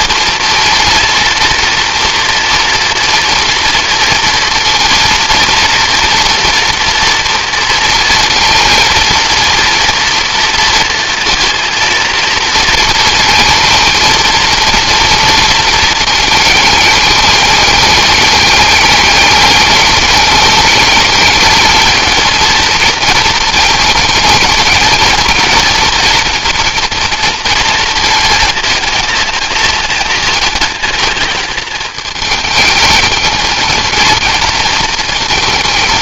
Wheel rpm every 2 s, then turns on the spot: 230, 230, 230, 230, 230, 230, 230, 230, 210, 210, 220, 220, 220, 240, 230, 220, 220, 230.
none